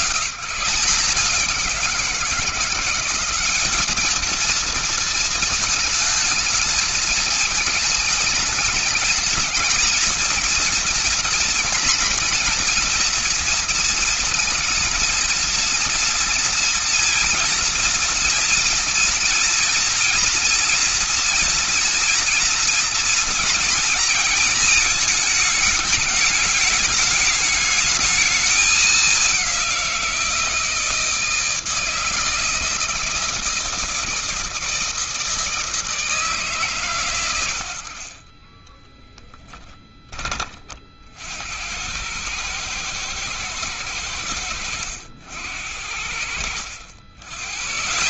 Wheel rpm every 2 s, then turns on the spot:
160, 180, 220, 220, 220, 230, 230, 230, 230, 230, 230, 220, 220, 210, 210, 160, 160, 160, 130, 20, 40, 110, 90, 80.
38-40